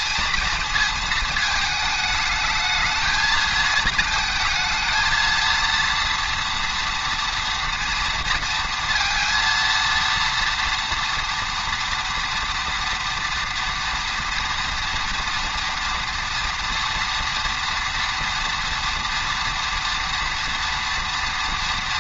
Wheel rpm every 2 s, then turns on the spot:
230, 220, 220, 240, 230, 230, 240, 240, 240, 230, 230.
none